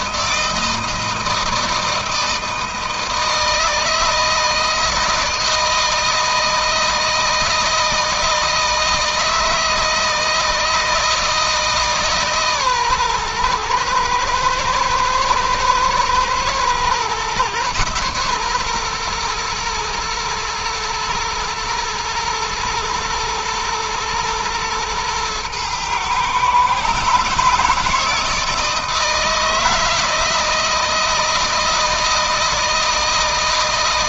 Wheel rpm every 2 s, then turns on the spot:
160, 160, 160, 160, 160, 160, 130, 110, 120, 120, 110, 110, 120, 140, 160, 160, 160.
none